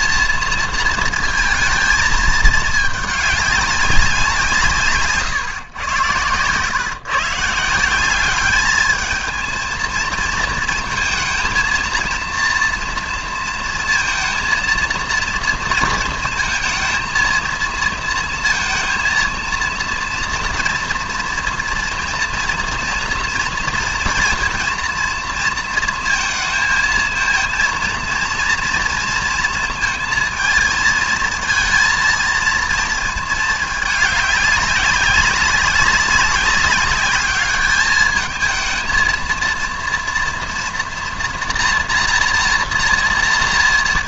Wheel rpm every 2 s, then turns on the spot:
230, 210, 150, 120, 210, 230, 230, 230, 230, 230, 230, 230, 230, 220, 230, 220, 230, 200, 200, 220, 230, 240.
none